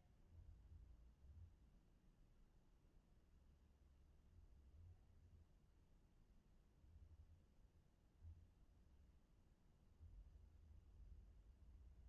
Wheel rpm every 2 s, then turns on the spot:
0, 0, 0, 0, 0, 0.
none